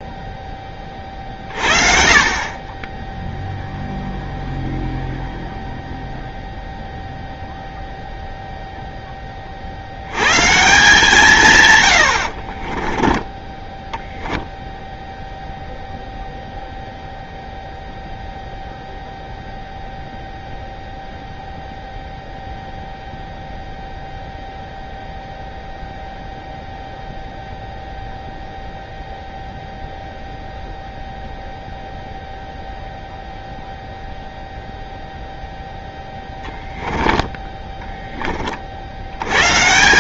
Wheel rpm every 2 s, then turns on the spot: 20, 20, 0, 0, 0, 150, 30, 0, 0, 0, 0, 0, 0, 0, 0, 0, 0, 0, 10, 40.
12-14